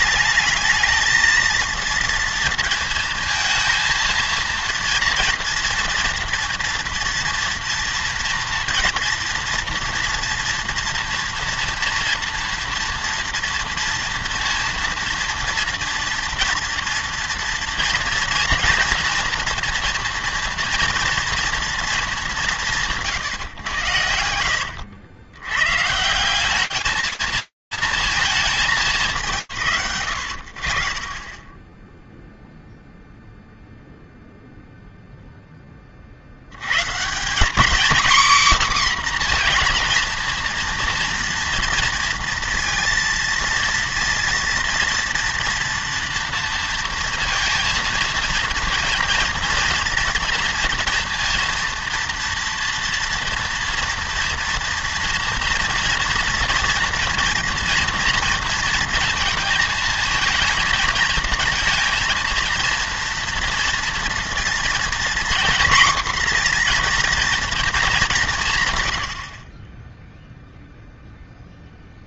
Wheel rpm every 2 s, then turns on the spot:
220, 230, 230, 230, 230, 230, 230, 230, 230, 230, 230, 200, 90, 190, 150, 40, 0, 0, 150, 250, 240, 230, 230, 230, 230, 230, 230, 230, 240, 230, 220, 230, 230, 230, 100, 0.
24-26